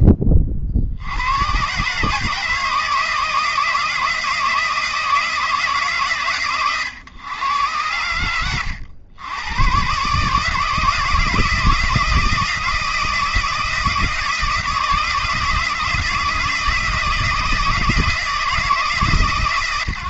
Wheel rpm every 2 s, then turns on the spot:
80, 160, 160, 100, 100, 160, 160, 160, 160, 140.
none